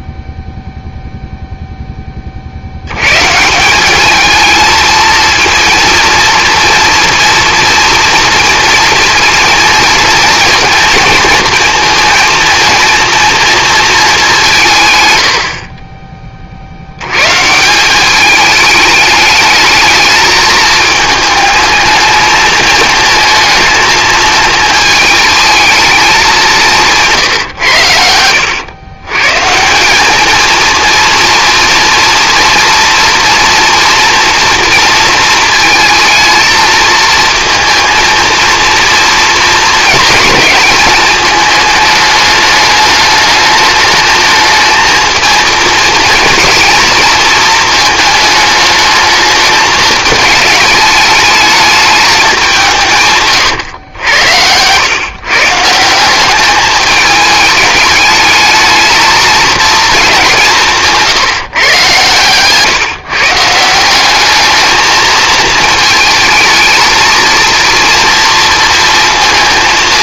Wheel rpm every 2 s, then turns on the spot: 0, 80, 230, 240, 240, 230, 230, 140, 70, 210, 220, 220, 220, 170, 110, 230, 230, 230, 220, 230, 220, 210, 220, 230, 220, 210, 150, 120, 210, 220, 170, 150, 220, 220, 230.
none